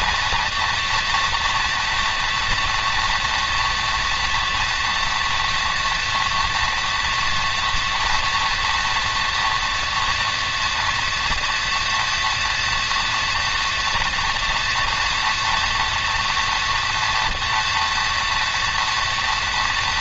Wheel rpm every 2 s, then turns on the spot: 230, 230, 240, 230, 230, 230, 230, 240, 230, 230.
none